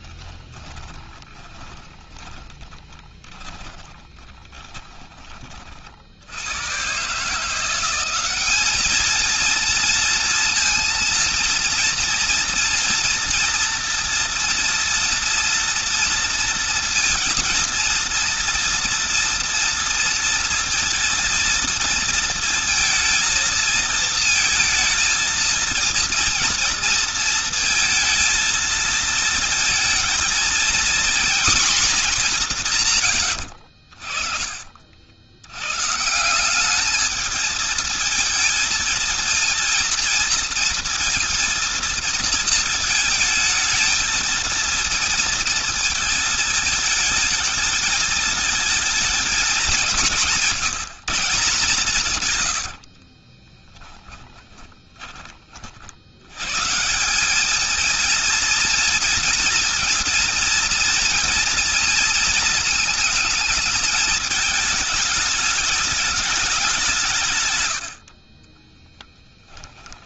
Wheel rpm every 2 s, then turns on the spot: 20, 20, 30, 120, 220, 230, 230, 230, 230, 230, 230, 230, 230, 230, 230, 230, 140, 70, 210, 230, 230, 220, 230, 220, 220, 180, 70, 20, 170, 230, 230, 230, 210, 170, 20.
0-4 52-56 68-70